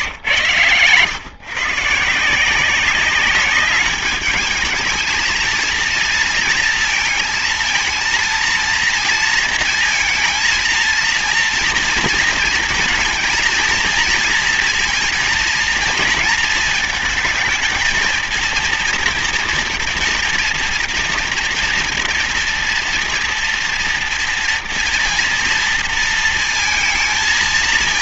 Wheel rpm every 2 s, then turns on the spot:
110, 180, 210, 230, 230, 230, 230, 230, 220, 230, 230, 230, 230, 230.
none